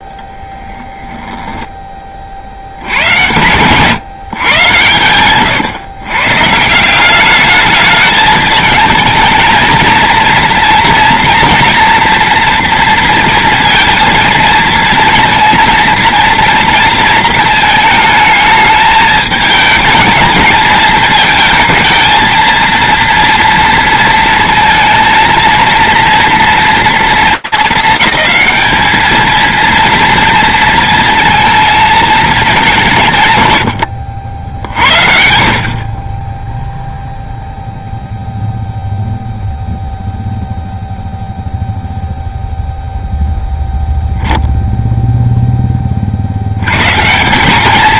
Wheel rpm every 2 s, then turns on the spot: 10, 60, 130, 150, 220, 230, 230, 230, 230, 220, 220, 230, 230, 230, 220, 230, 190, 70, 0, 0, 0, 0, 0, 190.
none